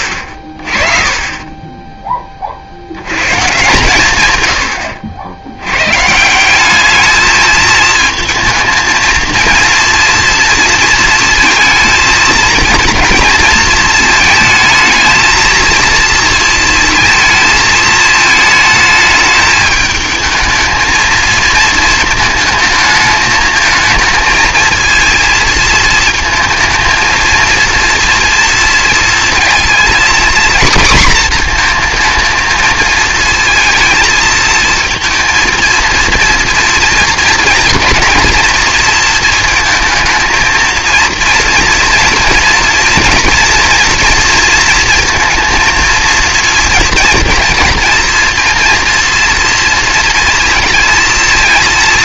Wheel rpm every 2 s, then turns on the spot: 30, 60, 90, 200, 220, 230, 230, 220, 230, 220, 220, 220, 230, 220, 230, 240, 220, 220, 240, 230, 230, 230, 230, 230, 230, 230.
none